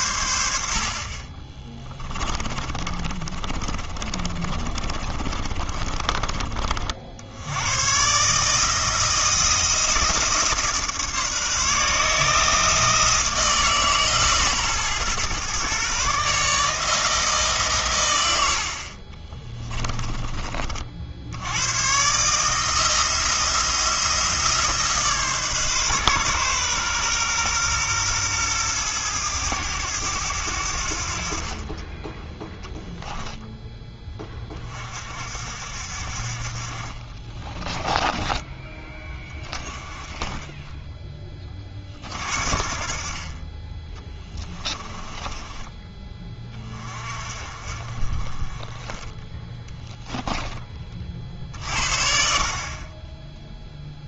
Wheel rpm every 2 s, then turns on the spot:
50, 30, 30, 60, 160, 150, 160, 130, 160, 40, 50, 160, 150, 130, 110, 70, 0, 40, 40, 30, 10, 40, 20, 30, 20, 30, 40.
2-6 36-38 44-46